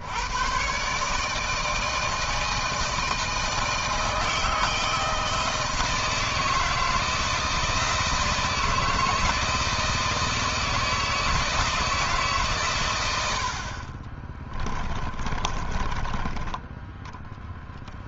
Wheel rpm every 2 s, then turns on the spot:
140, 160, 160, 160, 160, 160, 100, 30, 10.
14-16